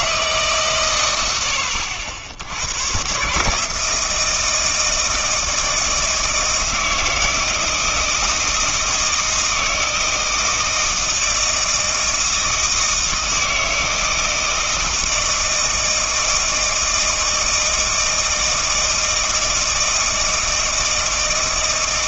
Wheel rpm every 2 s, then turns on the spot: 130, 110, 160, 160, 160, 160, 160, 160, 160, 160, 160.
none